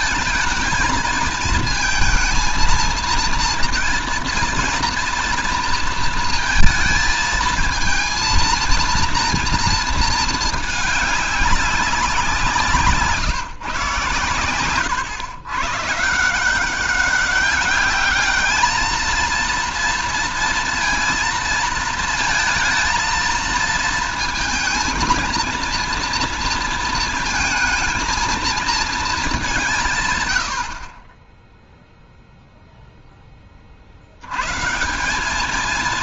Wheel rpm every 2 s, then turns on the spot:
220, 220, 230, 230, 230, 210, 180, 120, 180, 220, 230, 230, 230, 230, 220, 80, 0, 140.
none